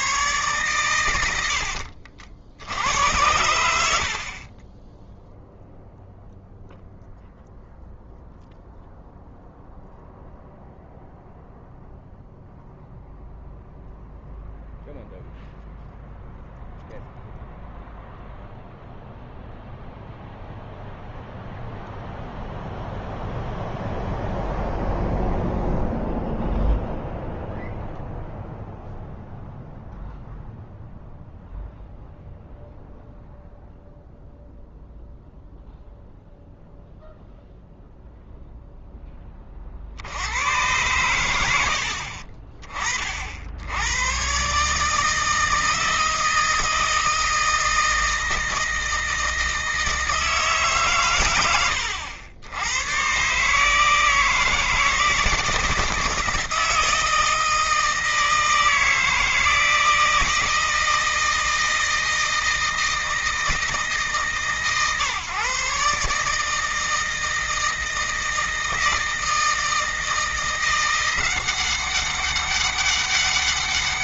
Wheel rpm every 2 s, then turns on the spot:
110, 100, 10, 0, 0, 0, 0, 0, 0, 0, 0, 0, 0, 0, 0, 0, 0, 0, 0, 10, 110, 50, 150, 160, 160, 120, 120, 160, 160, 160, 160, 160, 140, 160, 160, 180, 200.
none